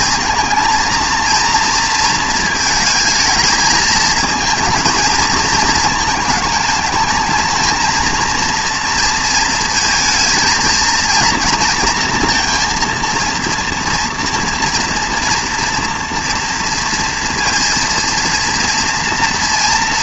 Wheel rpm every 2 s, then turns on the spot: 230, 220, 230, 220, 230, 230, 230, 240, 230, 230.
none